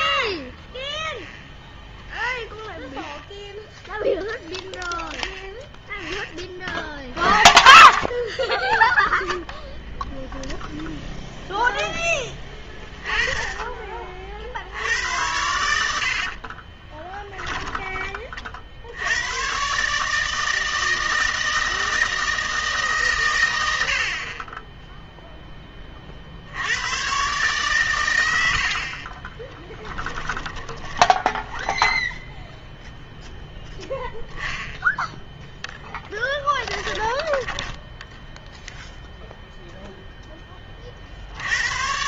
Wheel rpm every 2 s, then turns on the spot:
0, 0, 0, 30, 0, 0, 10, 70, 30, 60, 160, 150, 10, 90, 60, 20, 0, 0, 10, 0, 30.
16-18 28-32 36-38